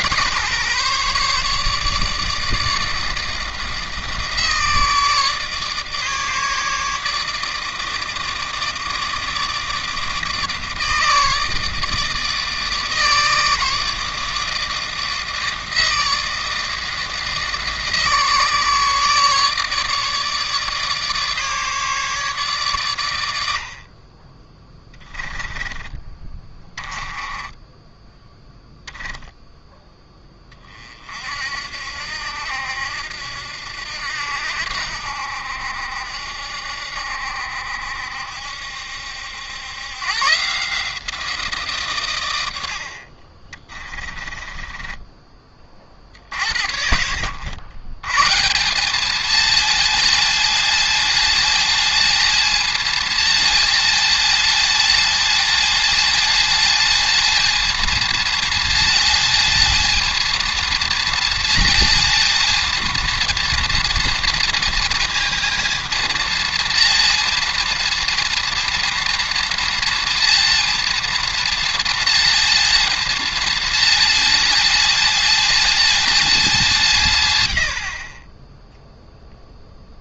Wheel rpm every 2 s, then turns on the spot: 140, 160, 150, 150, 160, 160, 150, 160, 160, 150, 150, 130, 20, 20, 0, 30, 70, 70, 70, 70, 150, 80, 20, 70, 170, 220, 230, 220, 220, 230, 230, 230, 230, 230, 230, 230, 230, 220, 200, 20.
26-28 44-46